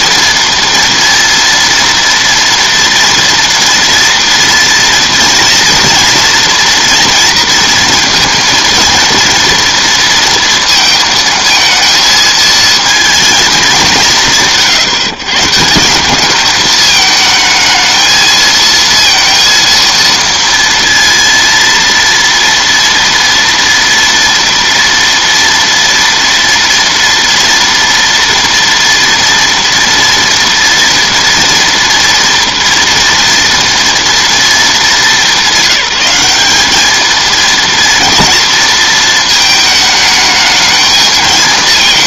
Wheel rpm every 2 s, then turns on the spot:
230, 240, 230, 230, 230, 230, 230, 160, 210, 230, 230, 230, 230, 230, 230, 230, 230, 220, 210, 230, 220.
none